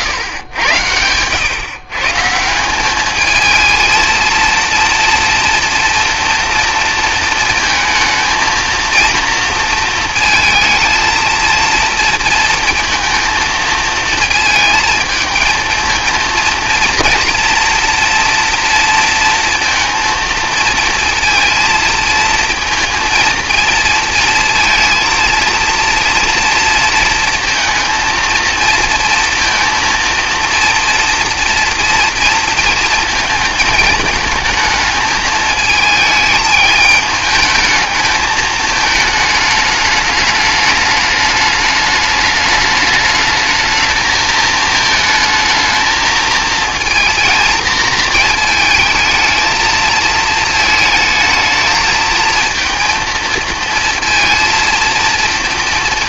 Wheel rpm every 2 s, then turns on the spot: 100, 190, 240, 230, 230, 220, 230, 220, 230, 230, 230, 230, 230, 230, 230, 230, 220, 210, 220, 220, 210, 210, 220, 230, 220, 220, 230, 230.
none